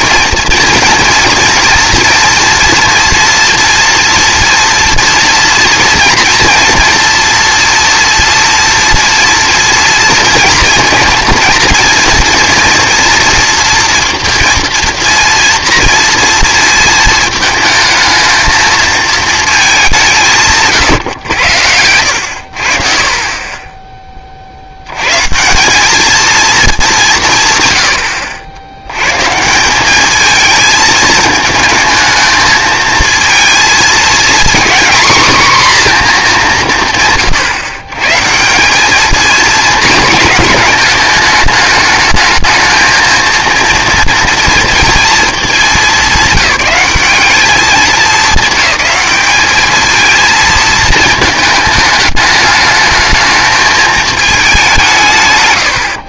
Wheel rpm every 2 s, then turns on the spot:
230, 230, 230, 230, 230, 230, 230, 230, 230, 220, 150, 60, 110, 200, 100, 220, 220, 250, 150, 210, 220, 220, 230, 190, 210, 220, 220, 170.
none